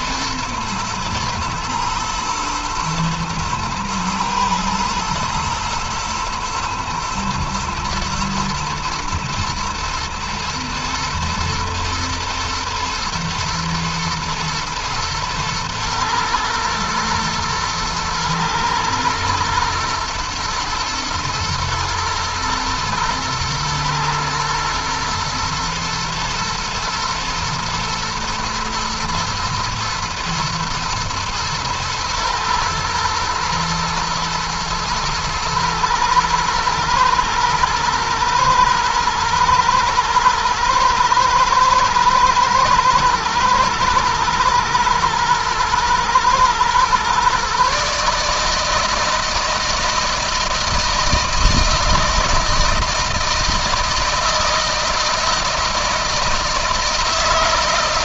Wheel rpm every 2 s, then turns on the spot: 110, 120, 110, 120, 120, 110, 120, 120, 110, 120, 110, 110, 120, 120, 110, 110, 110, 110, 110, 110, 110, 110, 110, 120, 150, 160, 160, 160, 160.
none